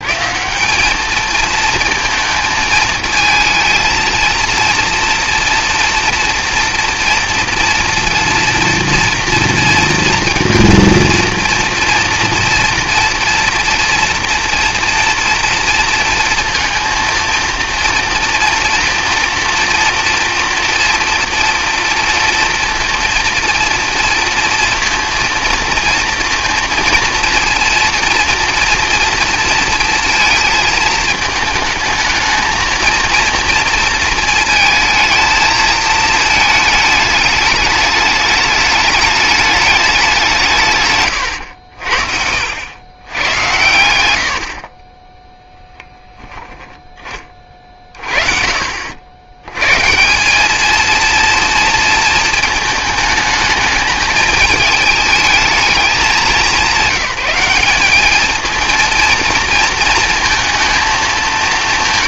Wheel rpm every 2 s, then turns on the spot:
200, 220, 230, 240, 230, 230, 240, 230, 230, 230, 230, 230, 230, 230, 230, 220, 230, 220, 210, 210, 130, 90, 30, 10, 60, 230, 220, 220, 200, 220, 210.
44-46